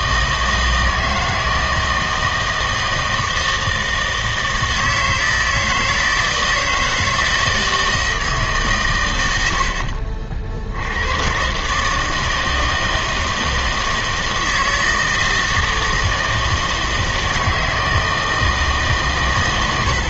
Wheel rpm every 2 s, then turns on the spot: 160, 160, 160, 160, 140, 70, 160, 160, 160, 160.
none